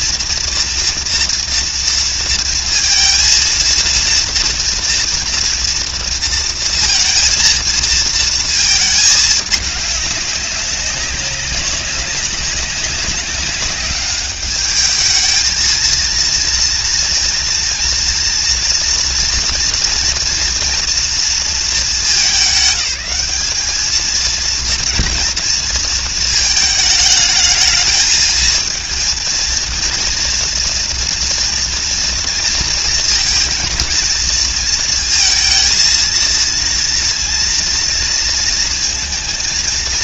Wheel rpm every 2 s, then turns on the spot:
230, 230, 240, 230, 220, 190, 200, 220, 240, 230, 230, 200, 240, 210, 230, 230, 230, 230, 240, 230.
none